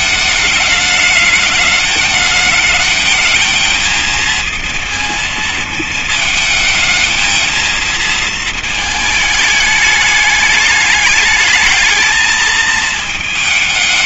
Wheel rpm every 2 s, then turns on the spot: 210, 220, 230, 220, 220, 210, 220.
none